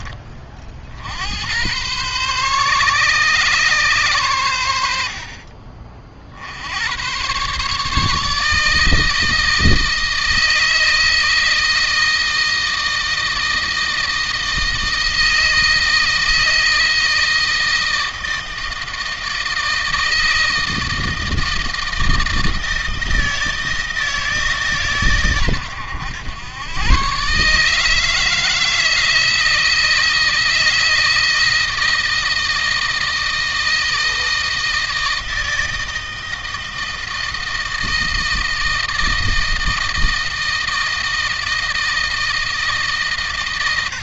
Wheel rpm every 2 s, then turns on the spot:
50, 130, 80, 80, 160, 160, 160, 160, 160, 160, 160, 160, 140, 110, 160, 160, 160, 160, 160, 160, 160, 160.
none